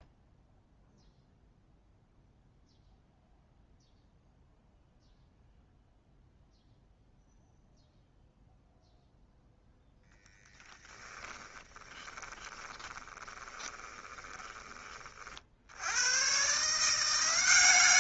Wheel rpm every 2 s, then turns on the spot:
0, 0, 0, 0, 0, 10, 20, 20, 140.
10-16